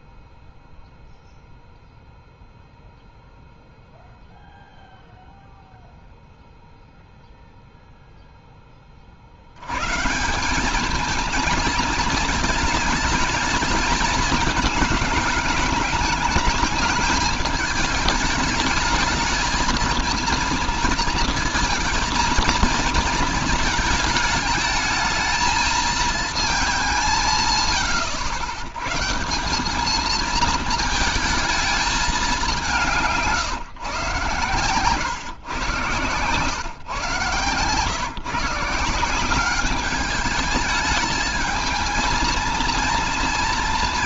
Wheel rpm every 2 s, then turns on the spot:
0, 0, 0, 0, 20, 200, 220, 210, 220, 220, 230, 230, 220, 190, 130, 230, 170, 120, 130, 180, 210, 230.
none